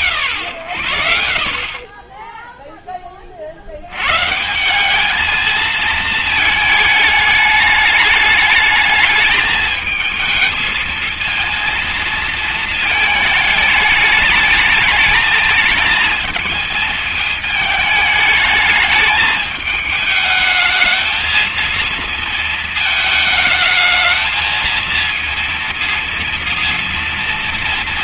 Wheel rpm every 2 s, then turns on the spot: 120, 10, 170, 220, 210, 220, 230, 220, 220, 210, 220, 220, 220, 230.
none